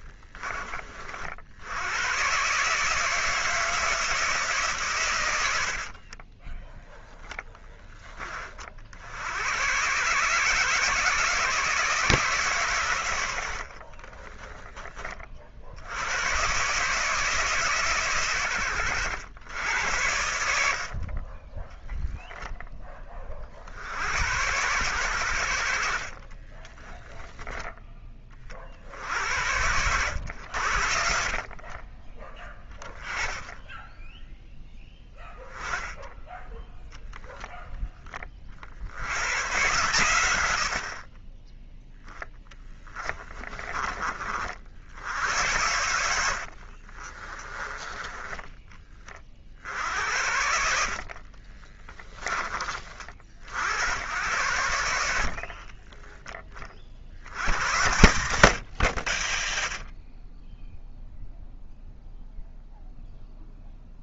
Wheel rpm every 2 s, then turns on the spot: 40, 160, 130, 10, 60, 150, 110, 30, 140, 100, 50, 20, 110, 10, 50, 70, 10, 10, 0, 80, 50, 20, 80, 50, 20, 60, 40, 80, 50, 100, 0, 0.
26-28 42-44 46-48 50-52